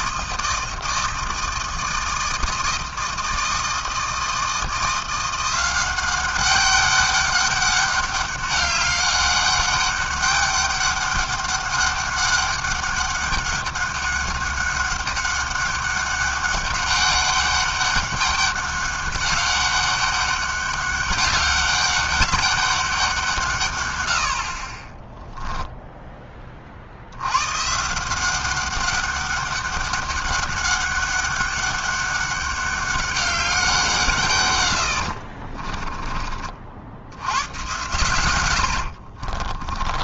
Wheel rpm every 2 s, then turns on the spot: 160, 160, 180, 200, 200, 200, 200, 200, 200, 200, 200, 170, 10, 90, 190, 200, 190, 50, 90, 40.
24-26 34-36 38-40